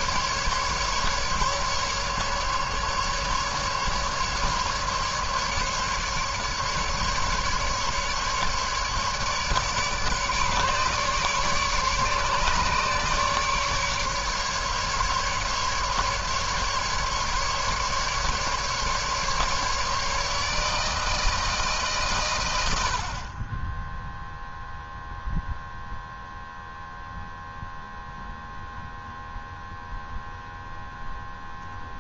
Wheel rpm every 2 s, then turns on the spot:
150, 150, 140, 140, 150, 150, 140, 140, 140, 140, 150, 130, 0, 0, 0, 0.
none